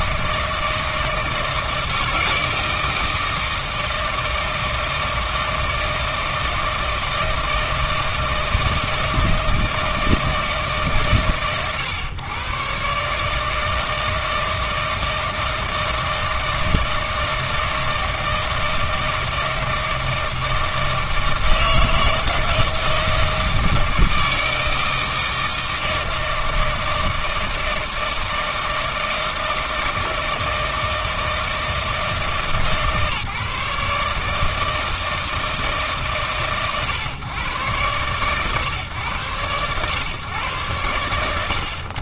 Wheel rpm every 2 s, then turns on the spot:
160, 160, 160, 160, 160, 140, 110, 160, 160, 160, 160, 160, 160, 160, 160, 160, 150, 160, 130, 130, 120.
none